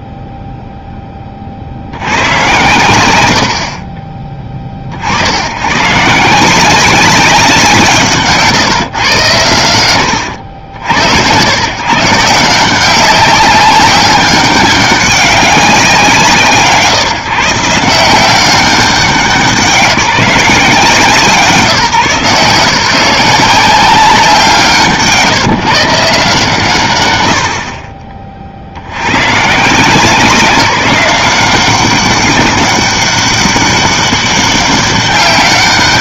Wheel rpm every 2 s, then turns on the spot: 0, 100, 50, 170, 140, 80, 160, 190, 140, 180, 160, 170, 170, 130, 60, 190, 190, 200.
none